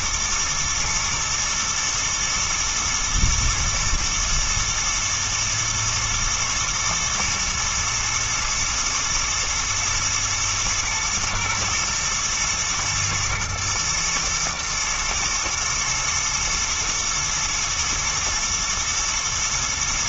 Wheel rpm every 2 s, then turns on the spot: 120, 110, 120, 110, 110, 120, 120, 120, 120, 110.
none